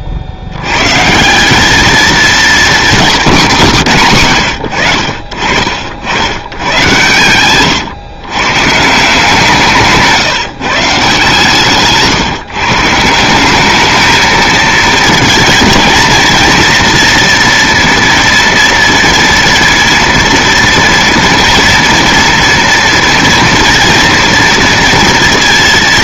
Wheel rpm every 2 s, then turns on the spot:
90, 220, 90, 110, 140, 160, 150, 220, 230, 230, 230, 230, 230.
none